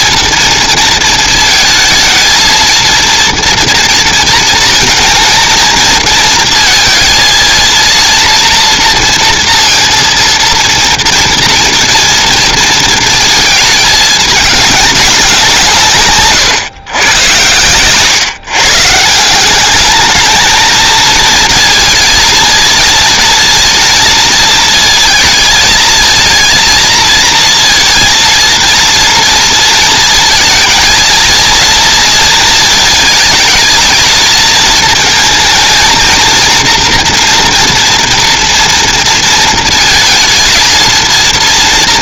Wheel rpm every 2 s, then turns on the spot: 230, 220, 230, 230, 230, 230, 230, 210, 120, 140, 220, 230, 220, 230, 230, 220, 220, 220, 230, 230, 220.
none